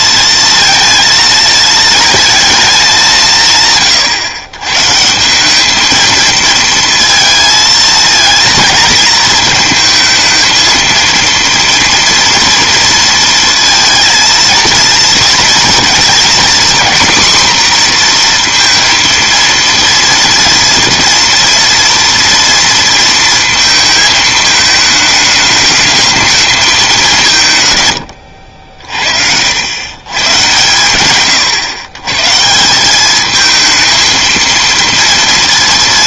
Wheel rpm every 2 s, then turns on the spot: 230, 220, 130, 230, 230, 230, 230, 230, 230, 230, 230, 230, 220, 220, 70, 120, 180, 230.
none